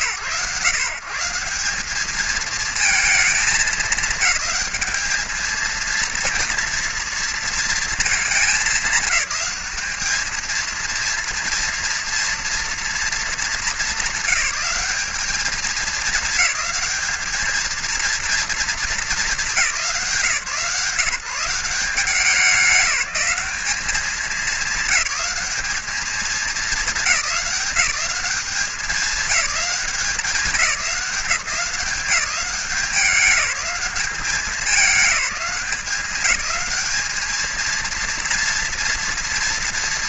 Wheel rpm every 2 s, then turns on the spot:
120, 220, 220, 230, 210, 220, 230, 200, 220, 220, 160, 180, 200, 200, 210, 200, 180, 210, 200, 230.
none